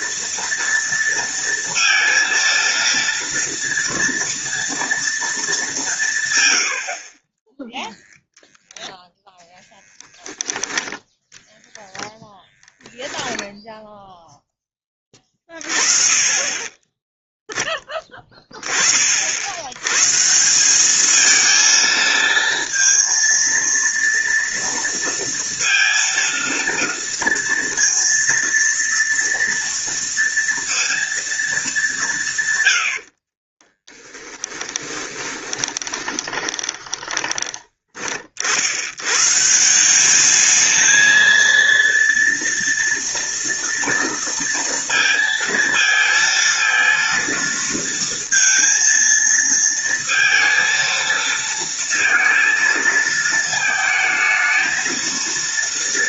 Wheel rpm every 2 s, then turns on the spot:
230, 230, 230, 80, 0, 10, 10, 10, 20, 30, 180, 230, 230, 230, 230, 230, 100, 20, 20, 70, 220, 230, 230, 230, 230, 230, 230, 220.
12-14 32-38